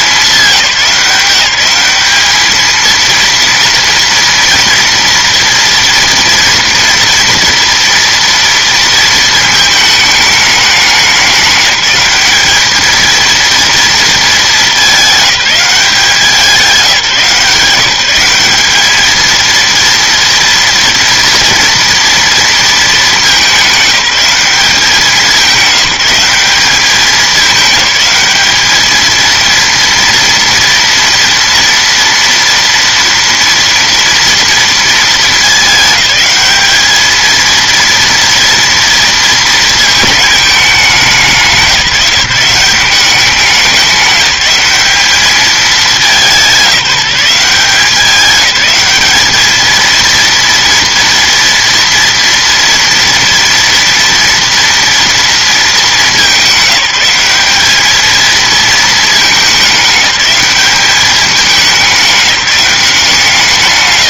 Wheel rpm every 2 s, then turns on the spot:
190, 220, 230, 230, 230, 200, 210, 200, 180, 210, 230, 230, 190, 200, 210, 230, 230, 230, 210, 230, 200, 180, 190, 180, 200, 230, 230, 230, 190, 220, 200, 180.
none